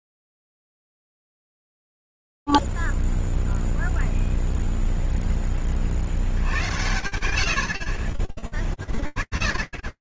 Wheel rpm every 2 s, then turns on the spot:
0, 10, 0, 20, 50.
2-4